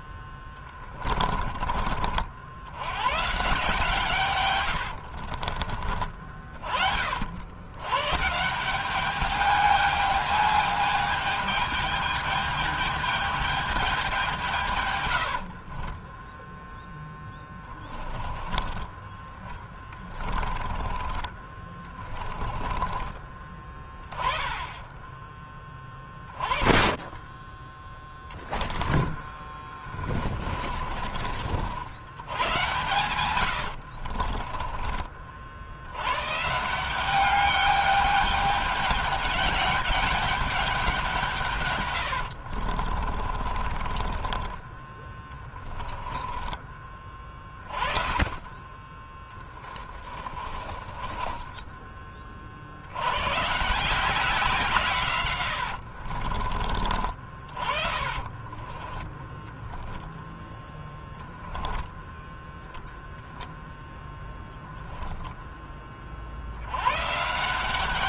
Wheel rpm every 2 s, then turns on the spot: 20, 80, 100, 40, 180, 210, 210, 150, 0, 20, 30, 20, 20, 20, 10, 30, 130, 50, 160, 200, 190, 60, 20, 20, 20, 30, 60, 150, 50, 20, 10, 0, 0, 90.
0-2 4-6 20-24 28-36 42-44 50-52 58-60